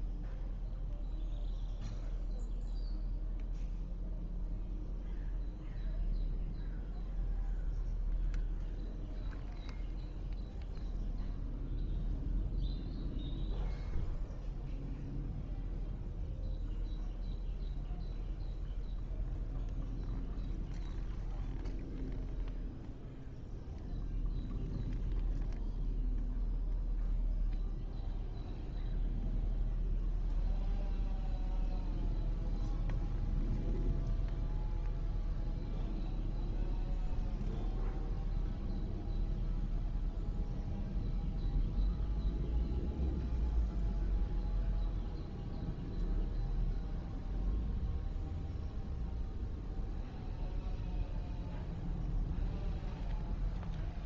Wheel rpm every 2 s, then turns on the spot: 0, 0, 0, 0, 0, 0, 0, 0, 0, 0, 0, 0, 0, 0, 0, 0, 0, 0, 0, 0, 0, 0, 0, 0, 0, 0, 0.
none